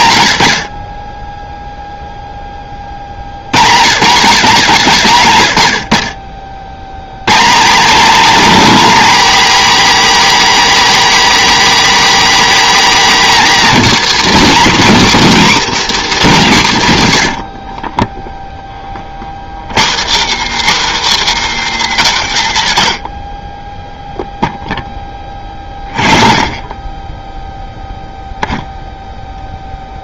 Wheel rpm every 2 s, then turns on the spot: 20, 20, 120, 80, 290, 300, 280, 250, 190, 20, 260, 100, 10, 20, 0.
none